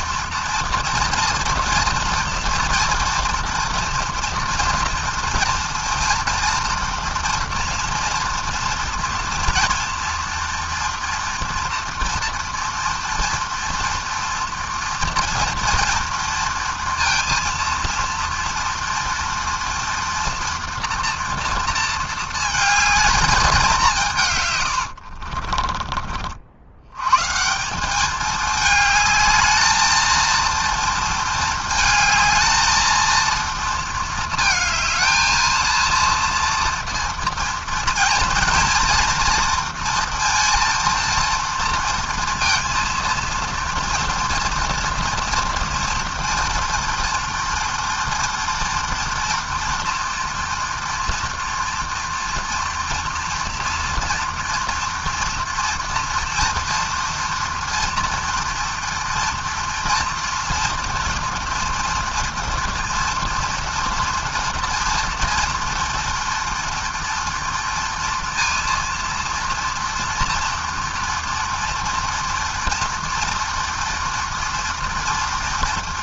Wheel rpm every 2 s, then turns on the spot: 230, 240, 230, 230, 230, 230, 230, 230, 230, 230, 230, 220, 50, 140, 220, 220, 230, 230, 230, 230, 230, 230, 230, 230, 240, 230, 230, 230, 230, 230, 230, 230, 230, 230, 230, 240, 230, 230.
24-26